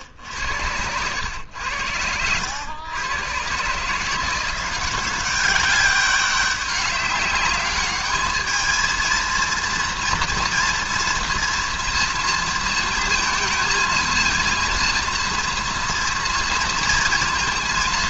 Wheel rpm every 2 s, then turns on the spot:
90, 100, 180, 200, 220, 230, 230, 230, 230.
none